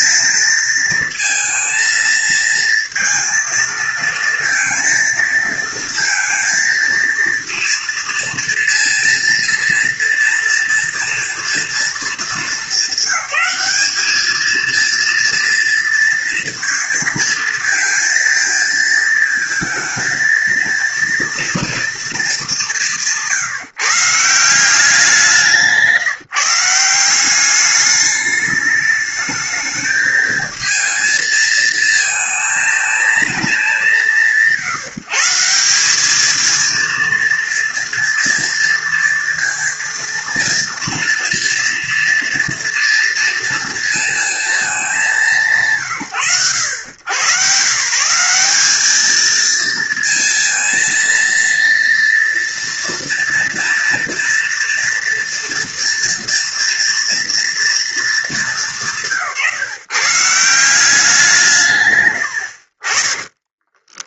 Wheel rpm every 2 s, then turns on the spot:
230, 230, 230, 230, 230, 230, 200, 220, 230, 230, 230, 190, 170, 170, 210, 220, 230, 150, 220, 230, 230, 230, 220, 120, 210, 230, 230, 230, 230, 180, 170, 70.
62-64